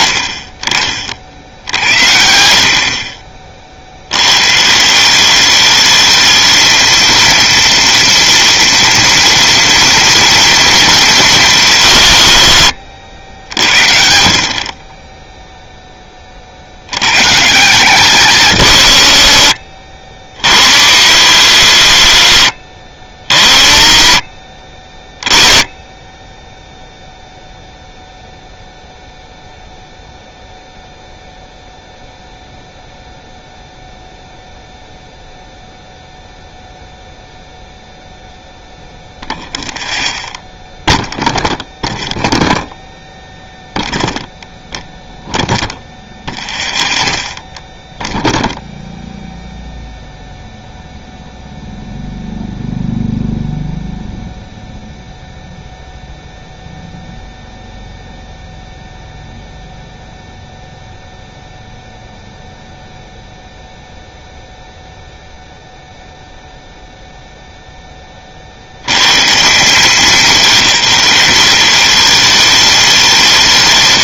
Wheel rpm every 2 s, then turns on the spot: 30, 50, 170, 220, 230, 230, 100, 20, 80, 100, 70, 60, 30, 0, 0, 0, 0, 0, 0, 0, 0, 0, 0, 0, 0, 0, 0, 0, 0, 0, 0, 0, 0, 0, 60, 190, 200.
none